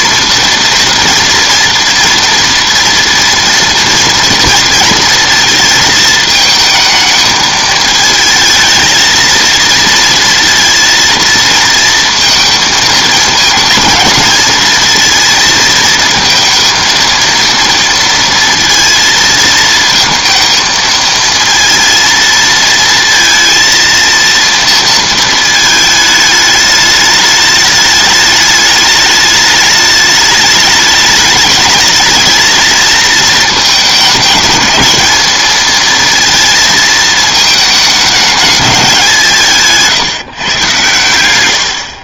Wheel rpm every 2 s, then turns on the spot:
240, 230, 230, 220, 220, 230, 220, 230, 230, 230, 220, 230, 230, 210, 210, 210, 230, 220, 220, 200, 130.
none